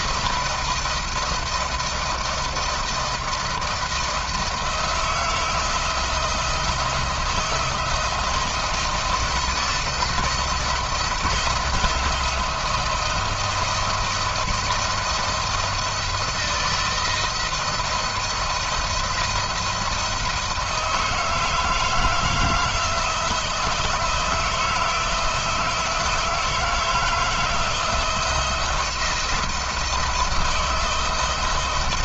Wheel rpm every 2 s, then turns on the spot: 170, 170, 160, 170, 160, 170, 170, 170, 160, 170, 160, 160, 160, 160, 170, 160.
none